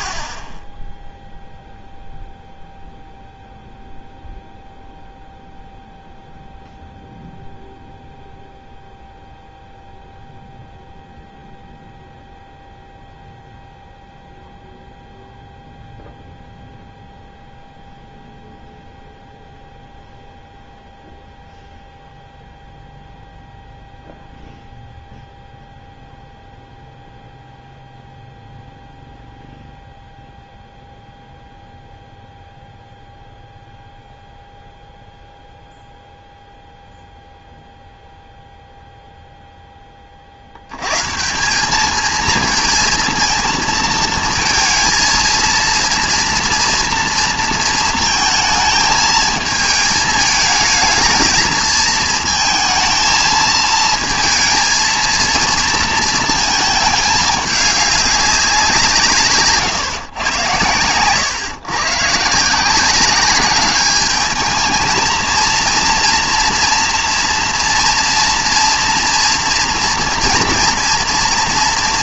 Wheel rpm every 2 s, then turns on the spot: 0, 0, 0, 0, 0, 0, 0, 0, 0, 0, 0, 0, 0, 0, 0, 0, 0, 0, 0, 0, 80, 220, 220, 230, 220, 220, 220, 230, 220, 180, 120, 160, 220, 230, 230, 230.
none